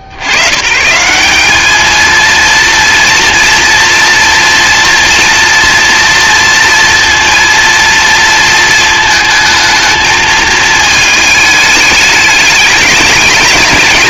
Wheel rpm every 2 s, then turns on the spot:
120, 230, 230, 230, 220, 220, 200.
none